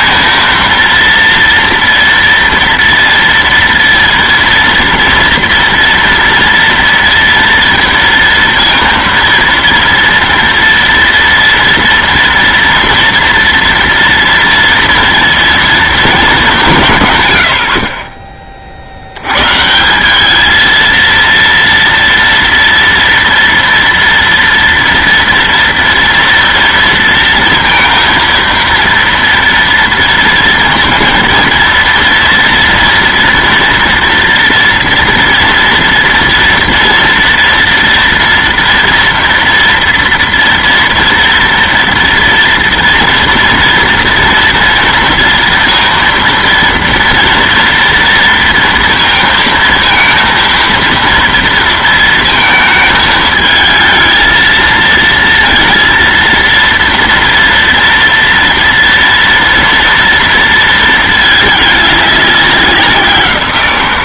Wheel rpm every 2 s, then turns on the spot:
230, 230, 230, 230, 230, 230, 230, 230, 160, 70, 230, 230, 230, 230, 230, 230, 230, 230, 230, 230, 230, 230, 230, 230, 230, 230, 220, 230, 230, 230, 220, 180.
none